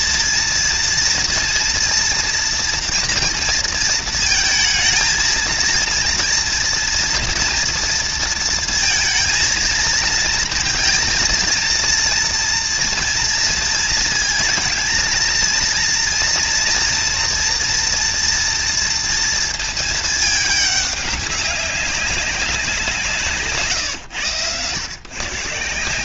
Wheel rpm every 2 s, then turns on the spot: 230, 220, 230, 230, 230, 230, 230, 230, 230, 210, 190, 110, 210.
none